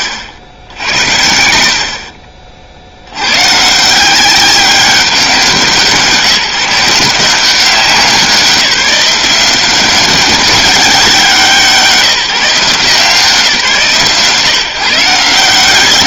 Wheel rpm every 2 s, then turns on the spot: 70, 80, 190, 170, 180, 190, 160, 150.
none